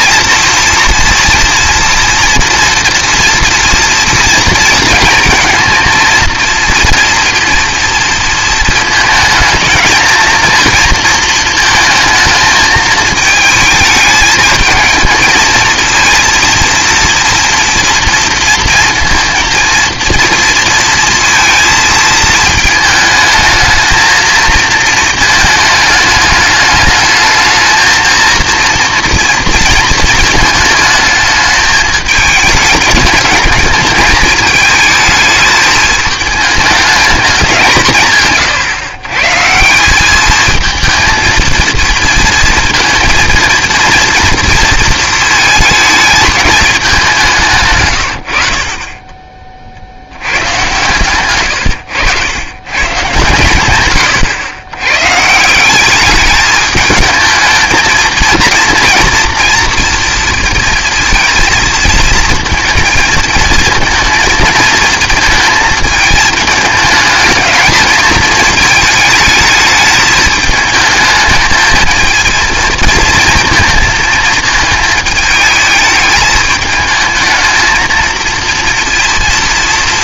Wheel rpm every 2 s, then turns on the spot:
230, 230, 230, 230, 230, 230, 220, 220, 230, 230, 230, 220, 220, 210, 230, 220, 220, 220, 210, 150, 220, 230, 230, 210, 60, 140, 120, 110, 210, 230, 230, 230, 220, 220, 220, 220, 230, 220, 220, 230.
none